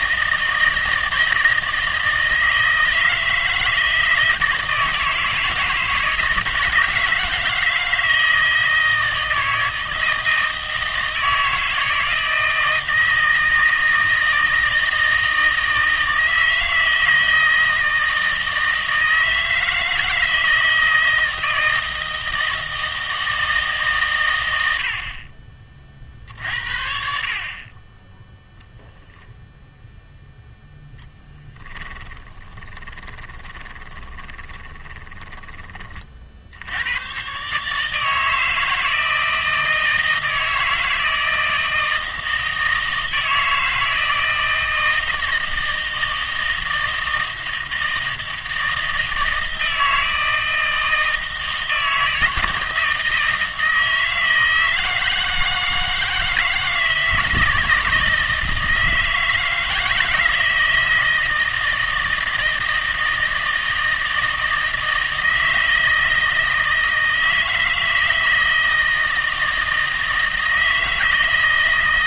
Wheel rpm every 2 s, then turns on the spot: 160, 160, 160, 160, 160, 160, 160, 160, 160, 160, 160, 160, 80, 60, 10, 0, 20, 20, 80, 160, 160, 160, 160, 160, 160, 160, 160, 160, 160, 160, 160, 160, 160, 160, 160, 160.
32-36